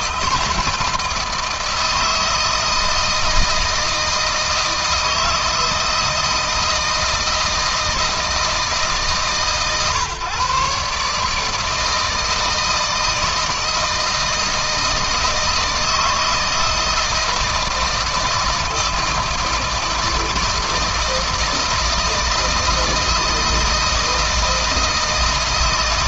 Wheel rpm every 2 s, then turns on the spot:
160, 160, 160, 160, 150, 140, 160, 160, 160, 160, 160, 160, 160.
none